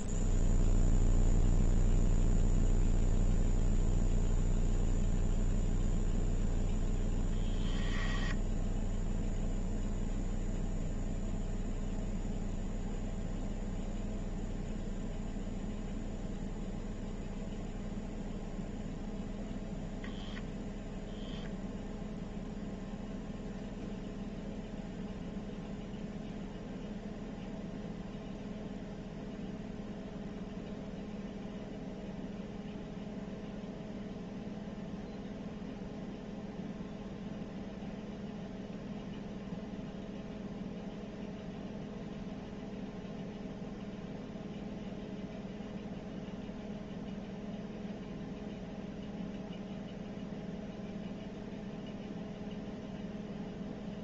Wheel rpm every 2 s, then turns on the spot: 0, 0, 0, 0, 10, 0, 0, 0, 0, 0, 0, 0, 0, 0, 0, 0, 0, 0, 0, 0, 0, 0, 0, 0, 0, 0, 0.
none